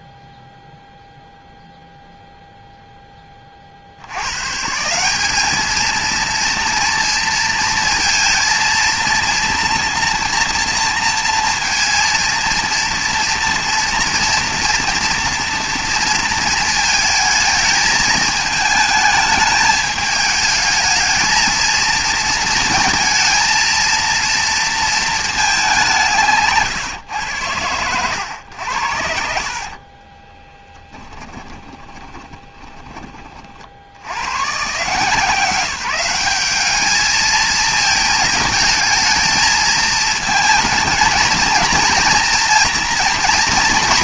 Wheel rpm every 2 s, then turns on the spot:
0, 0, 150, 230, 230, 230, 230, 230, 220, 220, 210, 230, 230, 140, 110, 10, 20, 130, 210, 220, 220, 230.
30-34